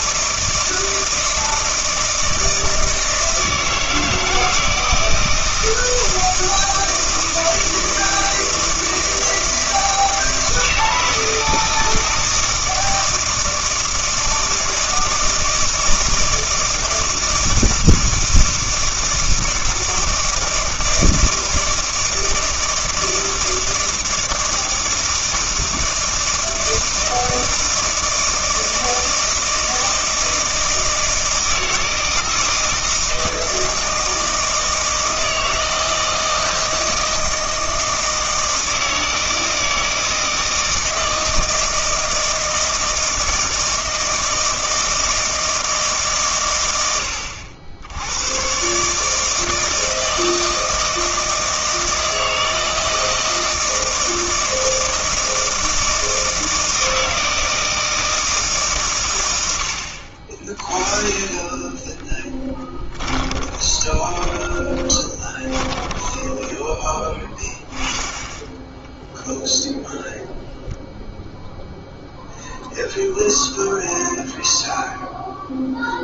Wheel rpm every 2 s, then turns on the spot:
160, 160, 160, 160, 160, 160, 160, 160, 160, 160, 160, 160, 160, 160, 160, 160, 160, 160, 160, 160, 160, 160, 160, 130, 120, 160, 160, 160, 160, 150, 30, 10, 20, 20, 10, 0, 0, 0.
62-68